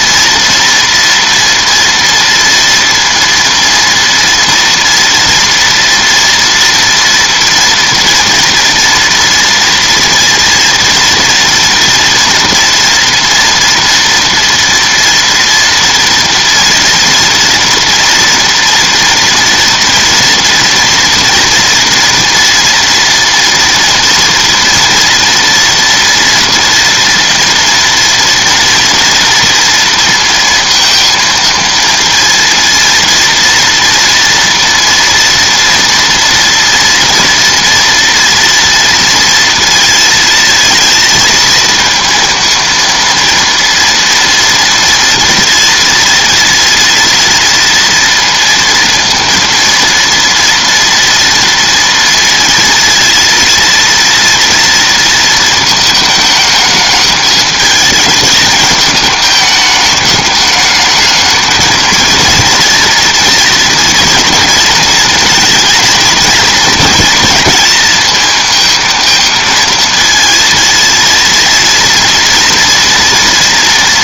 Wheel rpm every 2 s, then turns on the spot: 230, 230, 230, 230, 230, 240, 230, 230, 230, 230, 240, 240, 230, 230, 230, 230, 230, 230, 230, 230, 230, 230, 230, 240, 230, 230, 230, 230, 220, 210, 210, 230, 230, 220, 220, 230, 230.
none